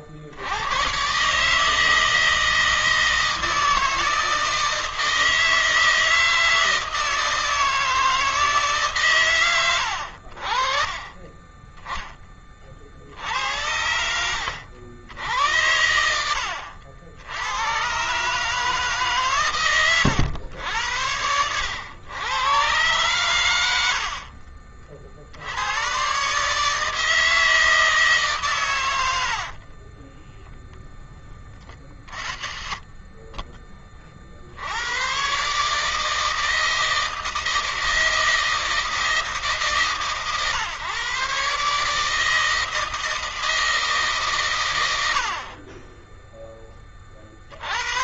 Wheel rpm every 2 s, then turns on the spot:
70, 160, 160, 160, 150, 40, 30, 80, 90, 150, 100, 120, 60, 150, 150, 20, 30, 70, 160, 160, 130, 160, 120, 20.
30-32